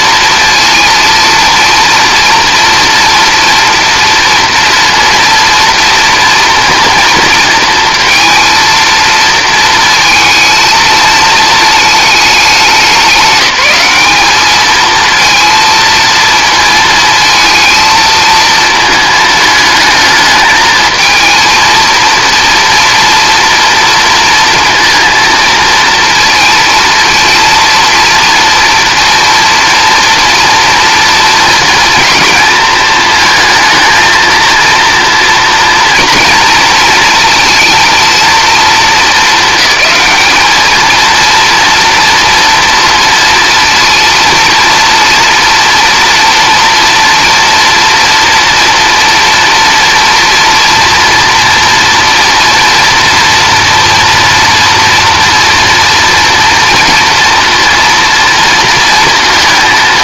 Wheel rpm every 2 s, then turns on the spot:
230, 230, 230, 240, 230, 220, 190, 220, 220, 220, 220, 230, 230, 230, 230, 230, 220, 230, 230, 220, 220, 230, 230, 240, 230, 230, 230, 230, 230, 230.
none